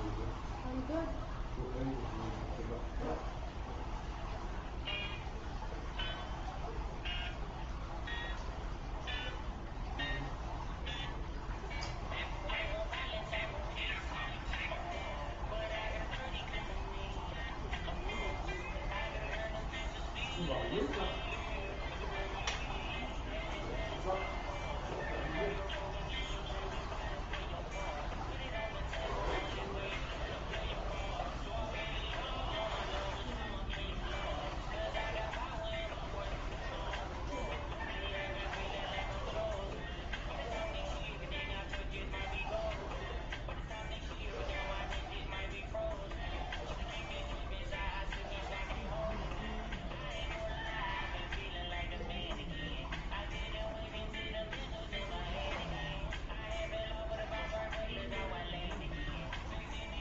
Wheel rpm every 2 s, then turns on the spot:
0, 0, 0, 0, 0, 0, 0, 0, 0, 0, 0, 0, 0, 0, 0, 0, 0, 0, 0, 0, 0, 0, 0, 0, 0, 0, 0, 0, 0, 0.
none